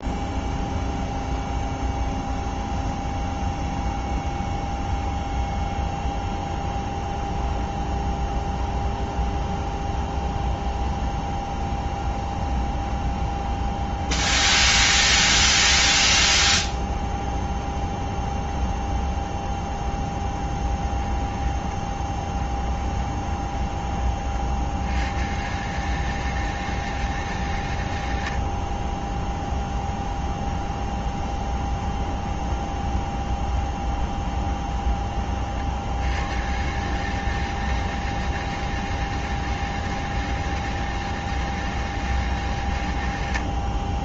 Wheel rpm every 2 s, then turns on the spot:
0, 0, 0, 0, 0, 0, 0, 0, 0, 0, 10, 10, 50, 160, 50, 0, 0, 0, 110, 160, 160, 140.
20-24